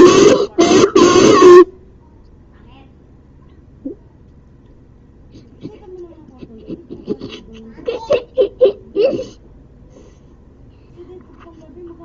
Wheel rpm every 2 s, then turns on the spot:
0, 0, 0, 0, 0, 0.
none